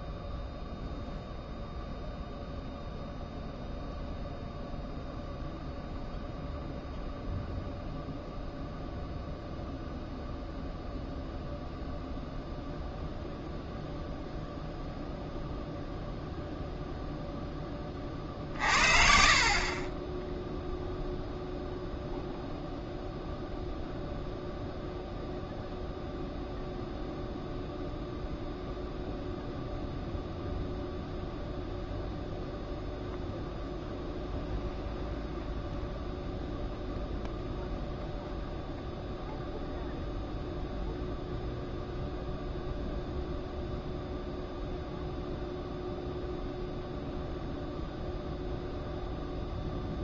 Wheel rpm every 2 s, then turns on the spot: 0, 0, 0, 0, 0, 0, 0, 0, 0, 40, 0, 0, 0, 0, 0, 0, 0, 0, 0, 0, 0, 0, 0, 0, 0.
none